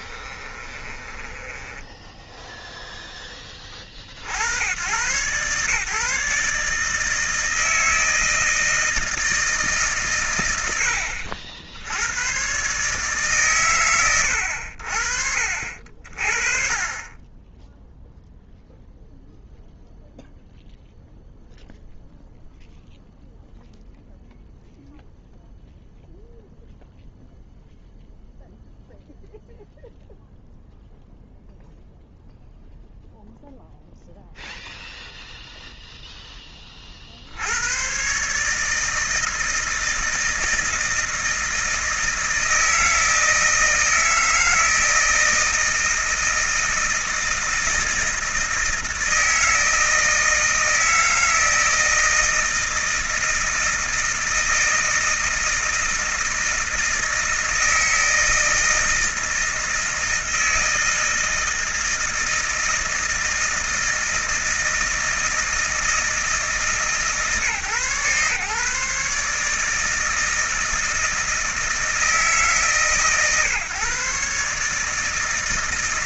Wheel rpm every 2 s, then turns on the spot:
20, 0, 110, 160, 160, 80, 150, 60, 30, 0, 0, 0, 0, 0, 0, 0, 0, 0, 40, 160, 160, 160, 160, 160, 160, 160, 160, 160, 160, 160, 160, 160, 160, 140, 150, 160, 140, 160.
0-2